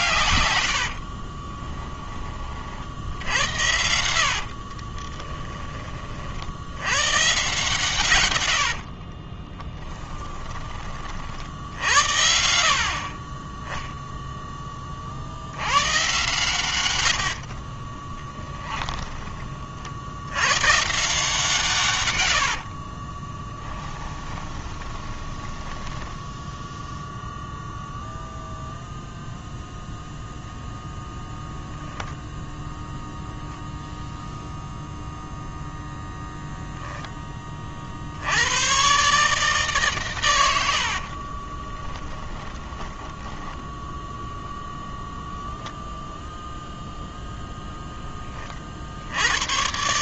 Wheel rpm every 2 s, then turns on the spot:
100, 40, 50, 70, 90, 20, 60, 10, 120, 20, 120, 70, 20, 0, 0, 0, 0, 0, 0, 100, 90, 10, 10, 0, 30.
0-2 4-6 8-10 18-20 22-26 42-44